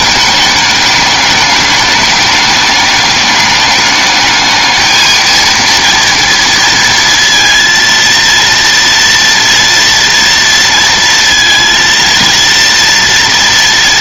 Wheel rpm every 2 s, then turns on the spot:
210, 210, 220, 230, 230, 230, 230.
none